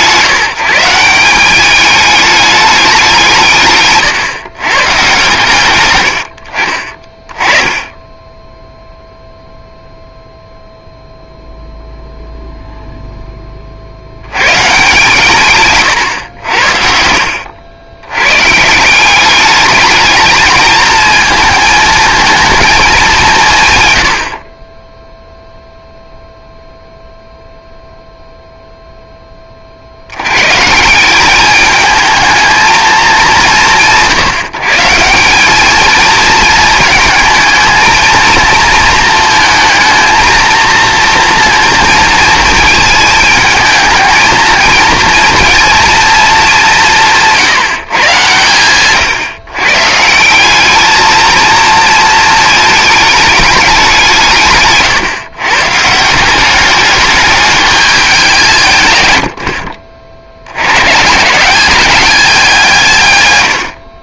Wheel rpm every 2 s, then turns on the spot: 170, 200, 130, 40, 0, 0, 0, 120, 70, 150, 220, 220, 20, 0, 0, 150, 220, 160, 220, 230, 230, 220, 220, 180, 130, 200, 220, 140, 200, 130, 120, 150.
none